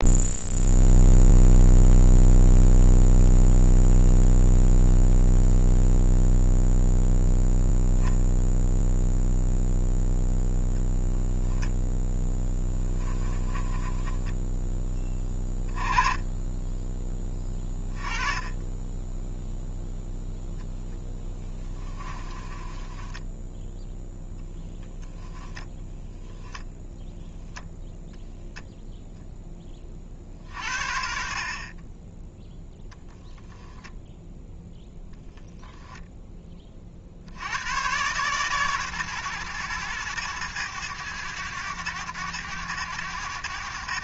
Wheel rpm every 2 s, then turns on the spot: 0, 0, 0, 0, 0, 0, 20, 10, 10, 20, 0, 20, 0, 0, 0, 60, 0, 0, 30, 130, 110, 100.
12-14 22-24